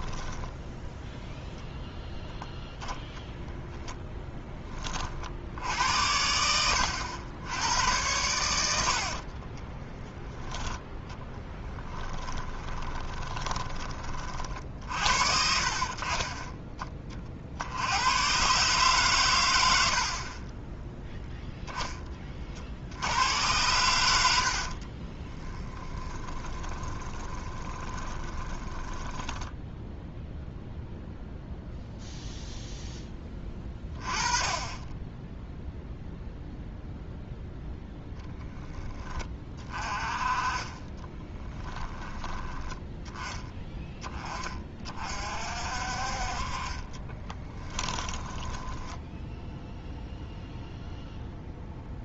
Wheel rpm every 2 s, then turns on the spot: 10, 0, 20, 80, 80, 10, 20, 50, 30, 140, 20, 50, 70, 20, 20, 0, 0, 20, 0, 20, 20, 10, 30, 40, 10, 0.
0-2 8-10 12-14 24-30 46-50